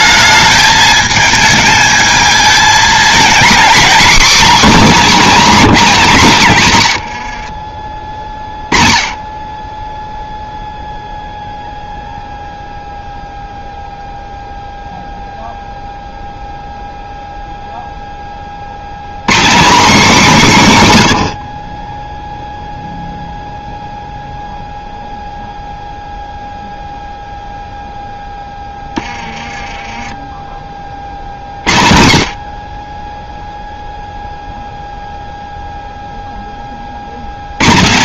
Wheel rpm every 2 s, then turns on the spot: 210, 220, 270, 140, 20, 0, 0, 0, 0, 100, 170, 0, 0, 0, 10, 30, 40, 0, 50.
none